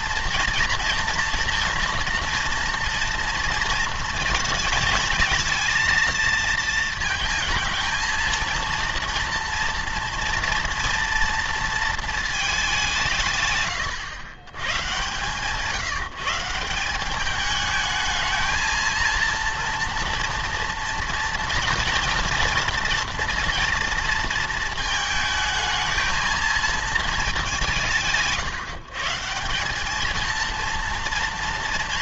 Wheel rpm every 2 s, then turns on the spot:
230, 230, 230, 230, 230, 230, 210, 120, 170, 230, 230, 230, 230, 220, 150, 230.
none